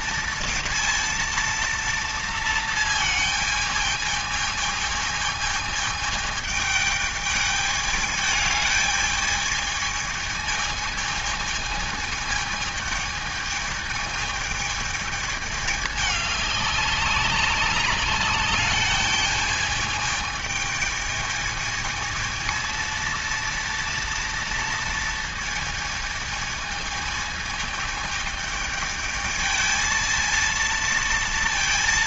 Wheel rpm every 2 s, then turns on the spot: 230, 230, 220, 220, 210, 220, 220, 220, 200, 210, 220, 230, 230, 220, 220, 230.
none